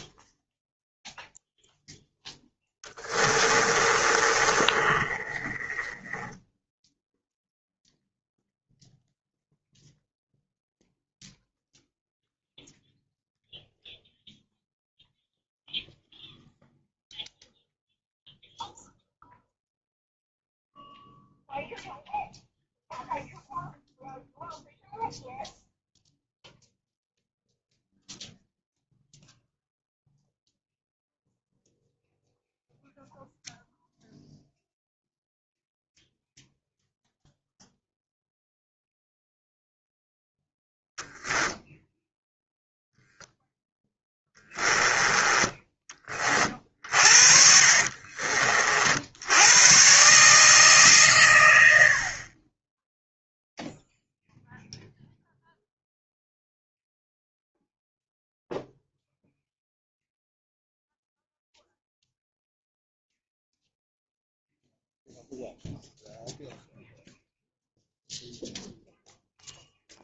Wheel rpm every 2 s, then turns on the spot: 0, 10, 30, 10, 0, 0, 0, 0, 0, 0, 0, 0, 0, 0, 0, 0, 0, 0, 0, 0, 10, 0, 10, 50, 60, 140, 10, 0, 0, 0, 0, 0, 0, 0, 0.
2-8 46-48